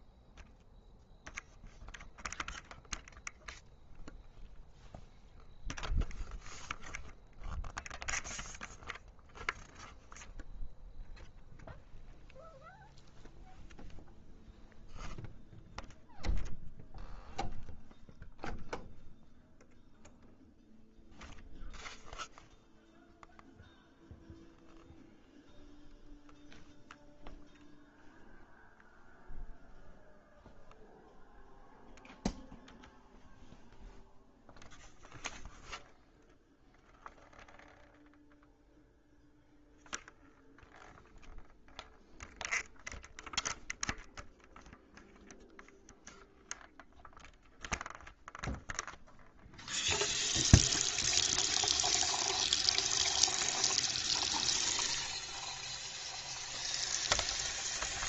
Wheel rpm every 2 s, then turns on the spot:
0, 0, 0, 0, 0, 0, 0, 0, 0, 0, 0, 0, 0, 0, 0, 0, 0, 0, 0, 0, 0, 0, 0, 0, 0, 0, 0, 0, 0.
none